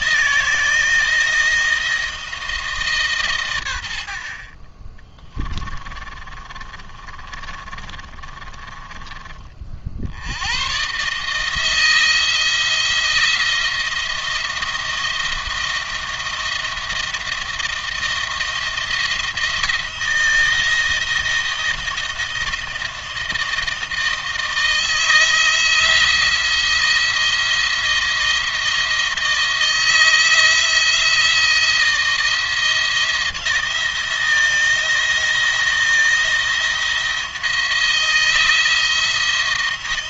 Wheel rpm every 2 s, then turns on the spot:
160, 150, 30, 30, 40, 130, 170, 170, 170, 170, 170, 170, 160, 170, 170, 170, 170, 170, 170, 160.
4-10